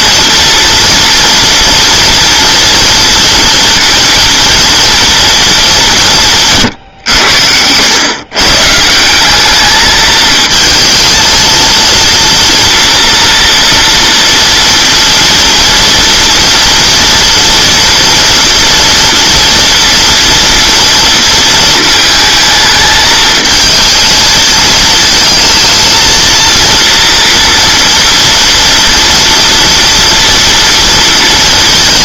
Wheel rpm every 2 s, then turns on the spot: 230, 230, 230, 140, 140, 220, 230, 230, 230, 230, 230, 220, 220, 230, 230, 230.
none